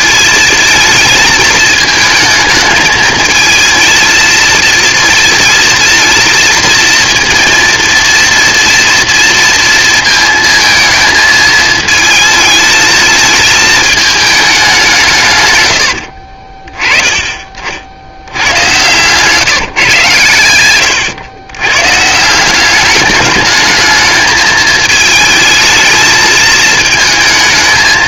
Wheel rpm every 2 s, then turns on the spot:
230, 220, 230, 230, 230, 220, 220, 190, 30, 110, 100, 190, 220, 220.
none